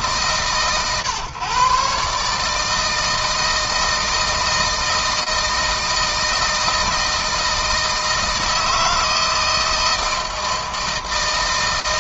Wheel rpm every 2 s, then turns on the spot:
130, 160, 160, 160, 160, 160.
none